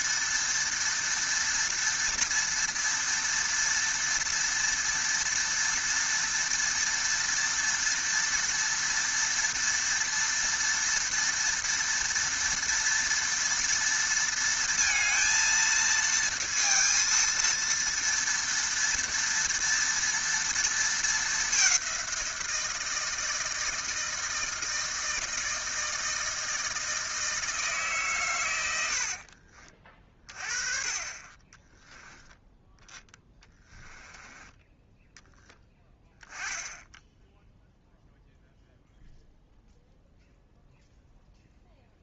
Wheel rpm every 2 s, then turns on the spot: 230, 230, 230, 230, 230, 230, 230, 230, 230, 230, 230, 170, 160, 160, 100, 20, 10, 10, 10, 0, 0.
none